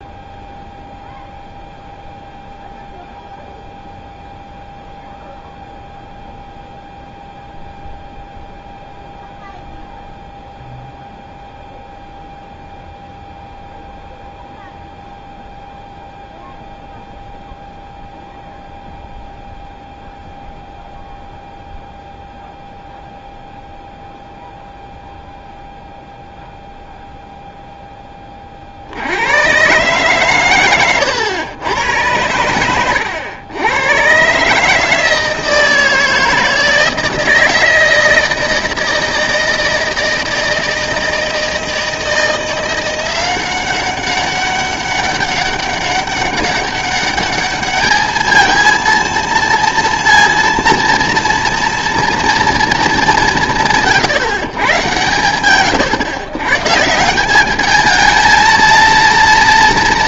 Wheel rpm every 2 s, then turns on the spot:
0, 0, 0, 0, 0, 0, 0, 0, 0, 0, 0, 0, 0, 0, 40, 110, 100, 150, 160, 160, 160, 170, 200, 200, 220, 230, 230, 130, 140, 230.
none